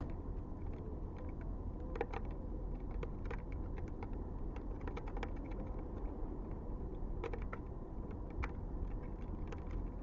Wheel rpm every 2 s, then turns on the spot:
0, 0, 0, 0, 0.
none